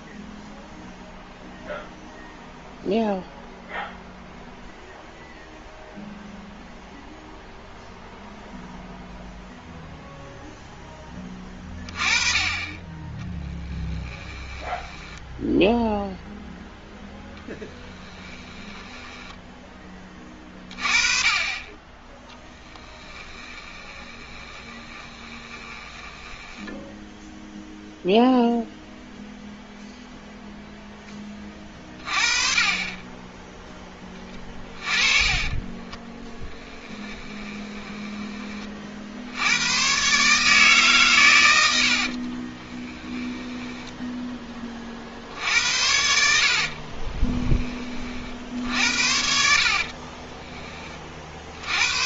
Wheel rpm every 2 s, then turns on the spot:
0, 0, 0, 0, 0, 10, 20, 10, 0, 10, 20, 10, 20, 10, 0, 0, 30, 20, 10, 40, 140, 20, 30, 40, 60, 30.
14-16 18-20 22-28 34-38 42-44 46-48